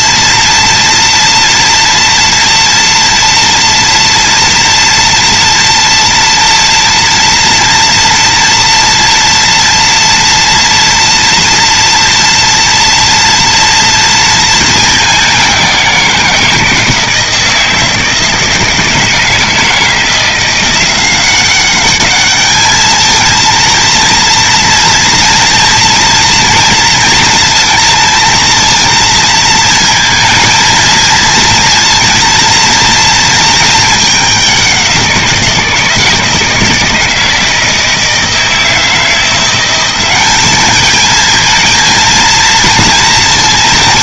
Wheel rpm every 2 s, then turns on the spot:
230, 230, 230, 230, 240, 230, 230, 210, 160, 160, 180, 220, 240, 230, 230, 230, 230, 180, 160, 160, 210, 230.
none